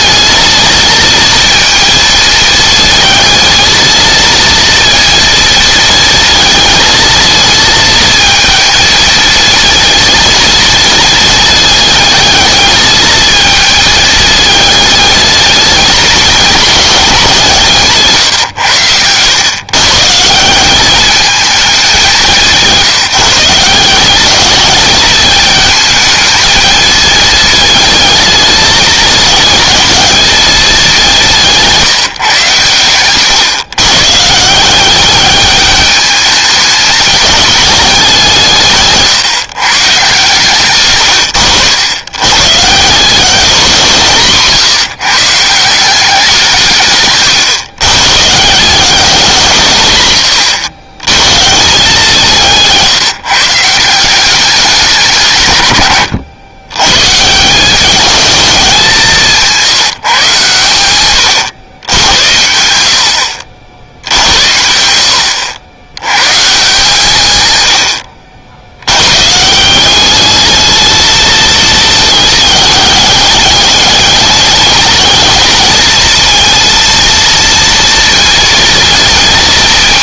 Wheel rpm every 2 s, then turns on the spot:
230, 220, 230, 220, 230, 230, 220, 220, 180, 100, 190, 180, 220, 230, 220, 210, 130, 180, 210, 150, 120, 150, 160, 150, 180, 100, 170, 200, 120, 190, 120, 90, 80, 150, 90, 220, 210, 210, 230, 230.
38-40